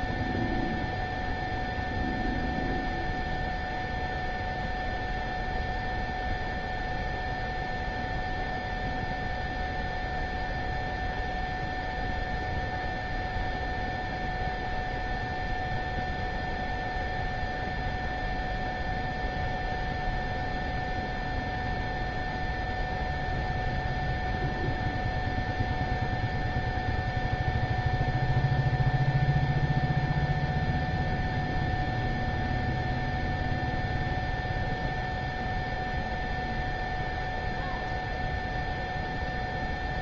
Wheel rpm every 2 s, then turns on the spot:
0, 0, 0, 0, 0, 0, 0, 0, 0, 0, 0, 0, 0, 0, 0, 0, 0, 0, 0, 0.
none